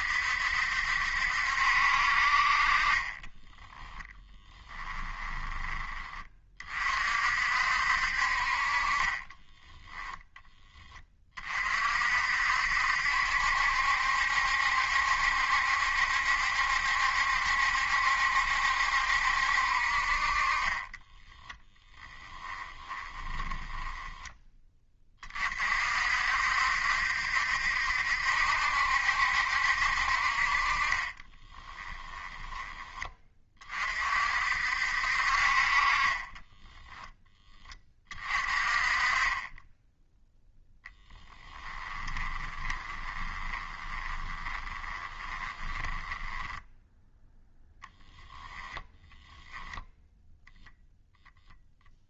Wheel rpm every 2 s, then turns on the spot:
70, 30, 10, 40, 30, 20, 70, 70, 70, 70, 20, 20, 20, 70, 70, 40, 20, 60, 10, 30, 10, 20, 20, 10, 10, 0.
4-6 20-24 30-32 40-46